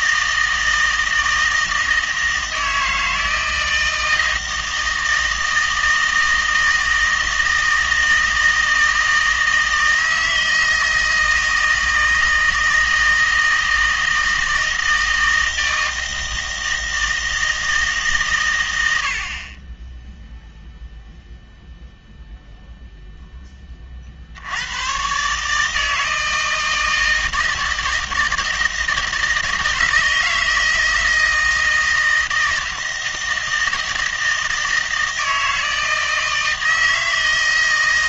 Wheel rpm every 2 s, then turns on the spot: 160, 160, 160, 160, 160, 160, 160, 160, 160, 100, 0, 0, 90, 160, 160, 160, 160, 160, 160.
none